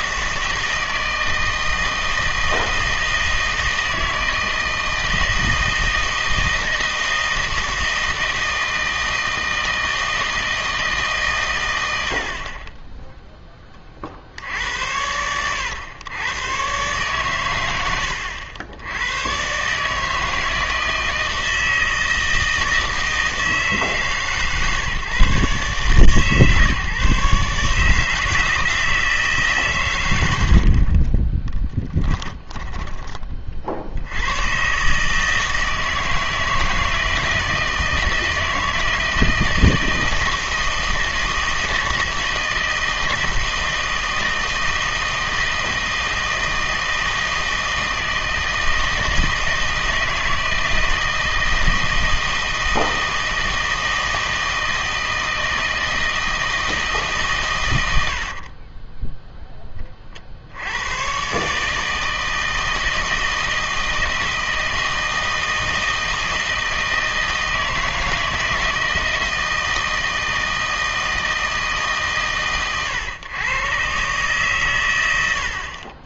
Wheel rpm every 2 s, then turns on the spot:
160, 160, 160, 160, 160, 160, 30, 100, 120, 80, 160, 160, 140, 150, 160, 60, 20, 120, 160, 160, 160, 160, 160, 160, 160, 160, 160, 160, 160, 30, 80, 160, 160, 160, 160, 160, 120, 120.
30-34 58-60